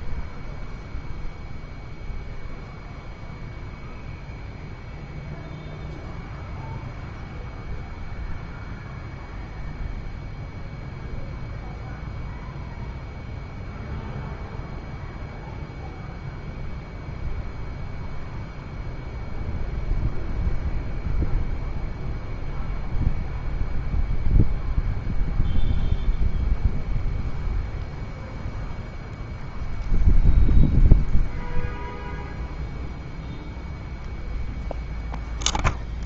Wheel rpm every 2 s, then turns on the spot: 0, 0, 0, 0, 0, 0, 0, 0, 0, 0, 0, 0, 0, 0, 0, 0, 0, 0.
none